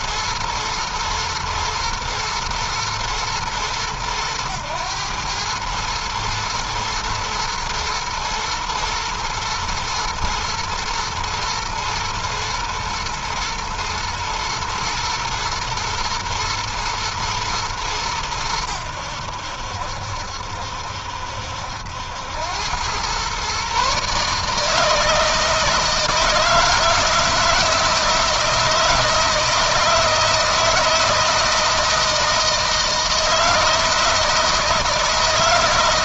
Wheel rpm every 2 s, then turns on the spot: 120, 120, 110, 110, 110, 110, 120, 110, 110, 100, 70, 100, 150, 160, 160, 170, 160, 160.
none